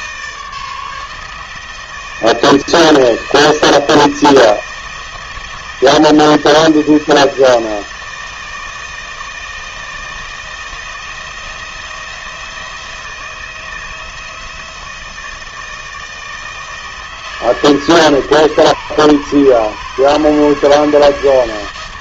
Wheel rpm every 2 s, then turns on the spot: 150, 160, 160, 170, 160, 170, 170, 160, 160, 150, 160.
none